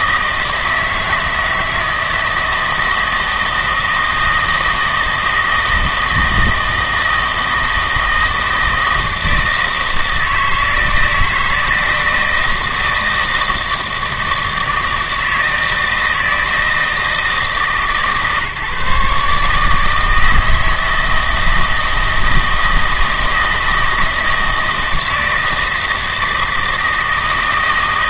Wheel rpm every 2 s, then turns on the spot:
160, 160, 160, 160, 160, 160, 160, 160, 160, 150, 160, 160, 160, 160.
none